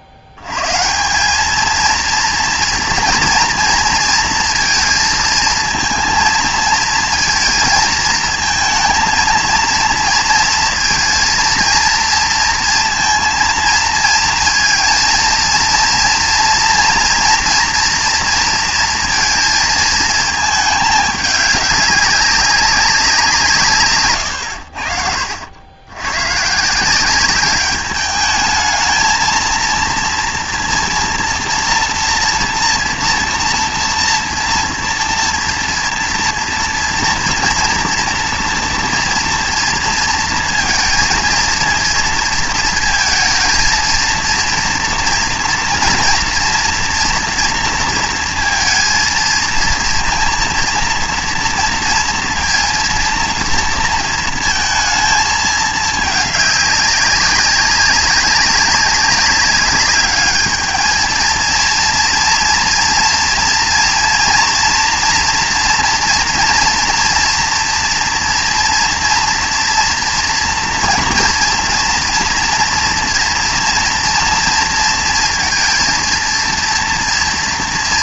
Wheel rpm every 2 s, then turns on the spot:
80, 230, 230, 220, 230, 230, 230, 230, 240, 230, 210, 200, 80, 150, 210, 230, 240, 240, 240, 230, 230, 220, 230, 230, 230, 230, 240, 230, 200, 200, 210, 230, 230, 230, 230, 230, 240, 230, 230.
none